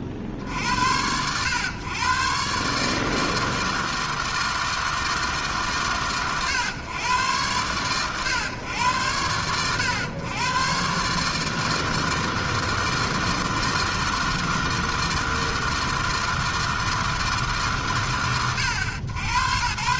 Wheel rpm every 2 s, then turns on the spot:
50, 140, 160, 110, 110, 120, 160, 160, 160, 90.
none